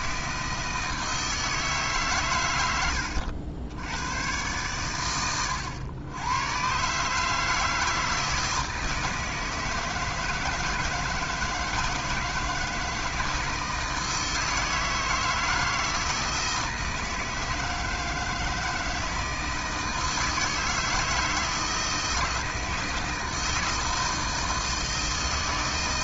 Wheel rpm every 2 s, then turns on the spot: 80, 120, 140, 160, 160, 160, 160, 160, 160, 160, 160, 160, 160.
none